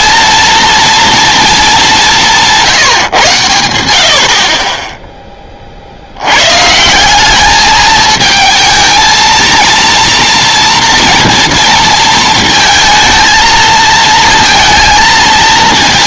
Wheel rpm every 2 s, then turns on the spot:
230, 150, 20, 160, 220, 230, 220, 220.
none